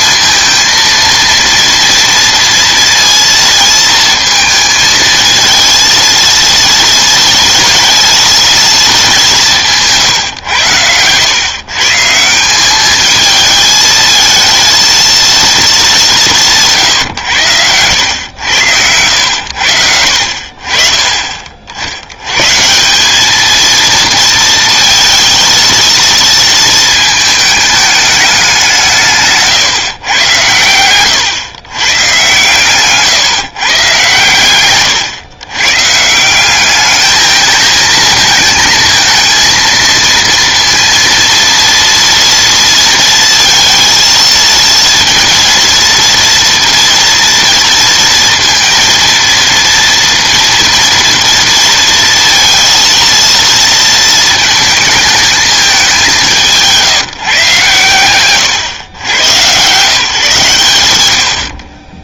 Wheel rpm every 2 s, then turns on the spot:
230, 230, 220, 230, 230, 110, 190, 220, 170, 100, 50, 140, 230, 230, 200, 100, 130, 120, 190, 220, 230, 230, 230, 230, 230, 230, 230, 220, 170, 110, 120.
none